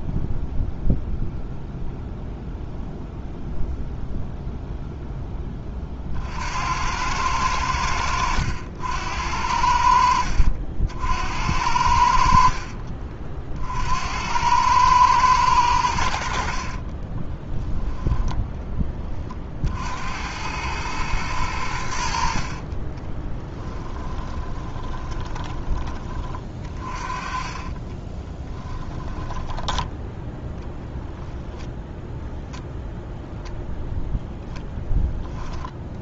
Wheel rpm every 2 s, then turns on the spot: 0, 0, 0, 90, 80, 60, 40, 110, 30, 10, 110, 30, 20, 30, 10, 10, 0, 0.
12-14 16-18 22-30